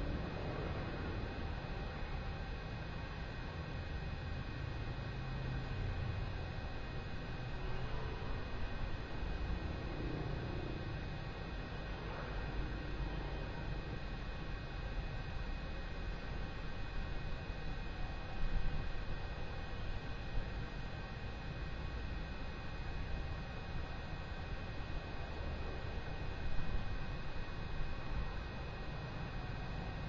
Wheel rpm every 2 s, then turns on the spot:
0, 0, 0, 0, 0, 0, 0, 0, 0, 0, 0, 0, 0, 0, 0.
none